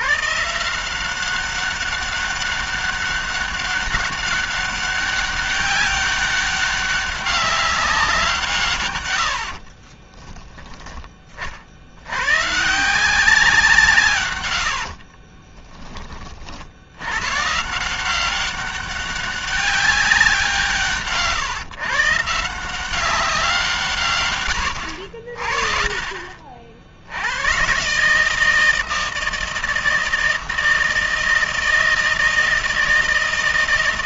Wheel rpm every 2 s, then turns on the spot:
190, 200, 200, 200, 80, 30, 180, 50, 100, 200, 150, 190, 70, 70, 160, 160, 160.
8-10 14-16